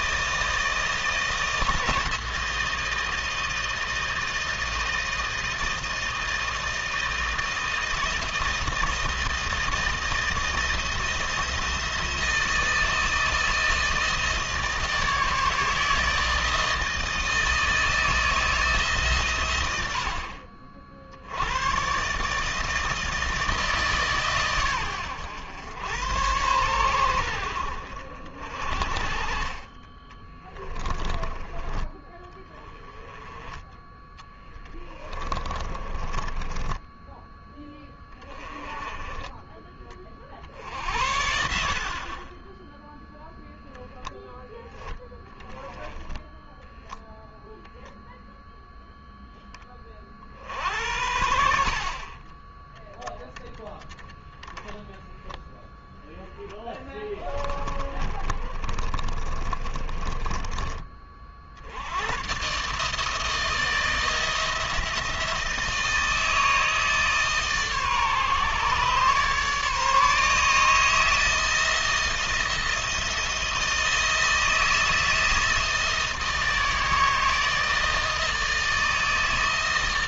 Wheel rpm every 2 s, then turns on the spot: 160, 160, 160, 160, 160, 170, 160, 150, 160, 130, 70, 160, 110, 90, 40, 20, 10, 20, 10, 20, 70, 0, 10, 0, 10, 70, 10, 10, 10, 30, 40, 160, 170, 150, 140, 160, 160, 160, 160, 160.
34-36 54-60